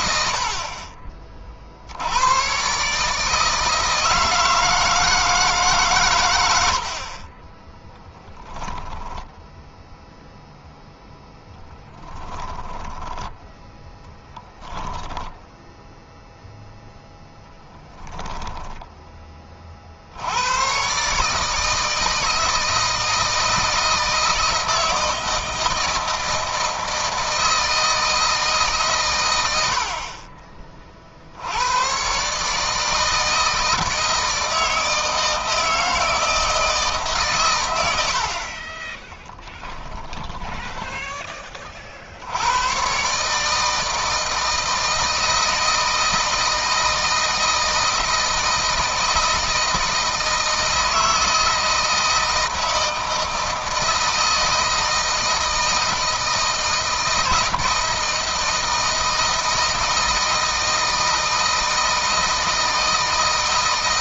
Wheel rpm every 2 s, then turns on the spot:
50, 120, 160, 90, 0, 0, 10, 10, 0, 0, 110, 160, 160, 160, 150, 40, 150, 160, 160, 30, 20, 110, 160, 160, 160, 160, 160, 160, 160, 160, 160, 160.
12-16 40-42